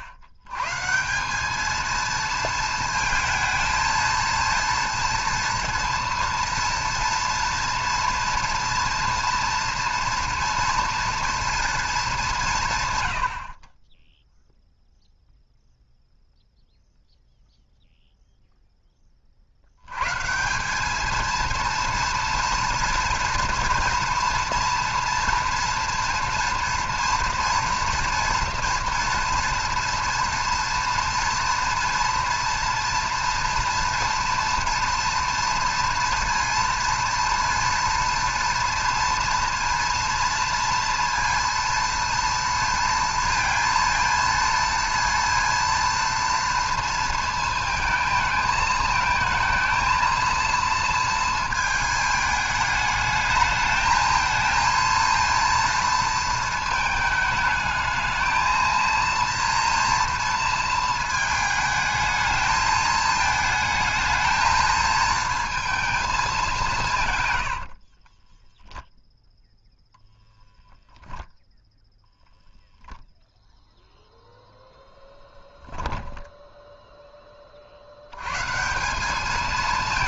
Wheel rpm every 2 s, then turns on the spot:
110, 230, 230, 230, 240, 230, 160, 0, 0, 0, 180, 230, 230, 230, 230, 230, 240, 230, 230, 230, 230, 230, 230, 230, 220, 230, 220, 230, 230, 230, 220, 220, 220, 170, 0, 10, 0, 0, 10, 150.
none